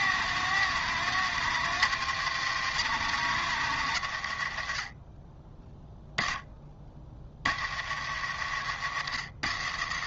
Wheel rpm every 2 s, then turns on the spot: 160, 140, 30, 30, 70.
none